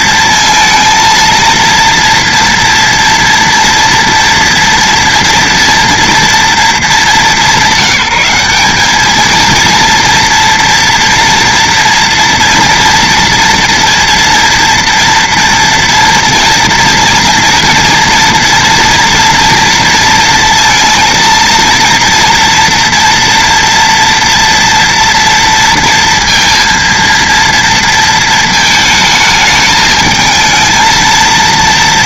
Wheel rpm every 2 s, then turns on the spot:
230, 240, 240, 210, 200, 230, 230, 230, 230, 240, 230, 230, 230, 230, 220, 220.
none